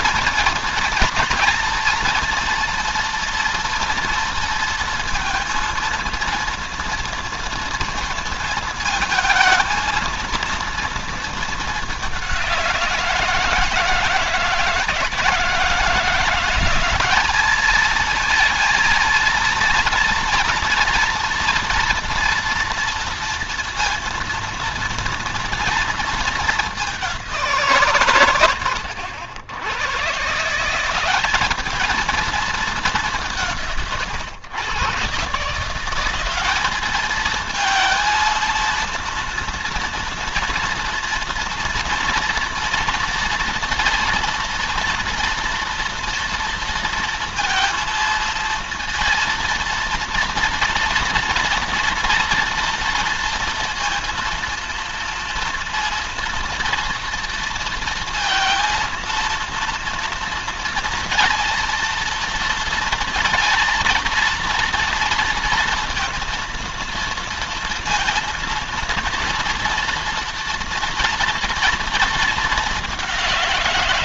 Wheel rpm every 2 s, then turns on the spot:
230, 230, 230, 230, 230, 230, 170, 160, 190, 230, 230, 230, 230, 210, 100, 170, 200, 120, 210, 230, 230, 230, 230, 230, 230, 230, 230, 230, 230, 230, 230, 230, 230, 230, 230, 230, 200.
none